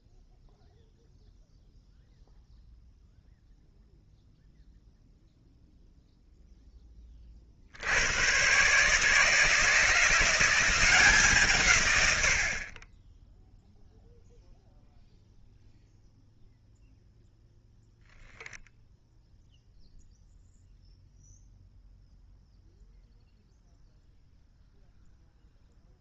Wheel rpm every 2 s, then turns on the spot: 0, 0, 0, 0, 130, 180, 50, 0, 0, 0, 0, 0, 0.
none